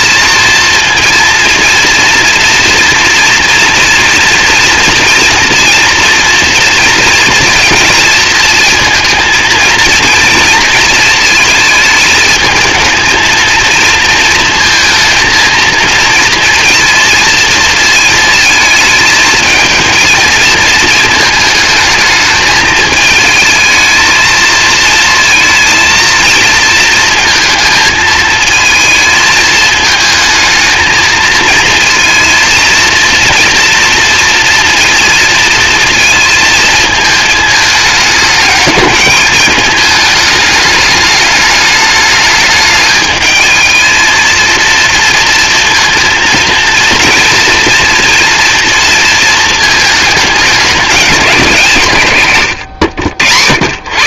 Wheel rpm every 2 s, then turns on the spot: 230, 230, 230, 230, 220, 230, 220, 230, 230, 220, 230, 220, 220, 230, 220, 220, 230, 230, 220, 210, 210, 210, 230, 230, 230, 210, 110.
none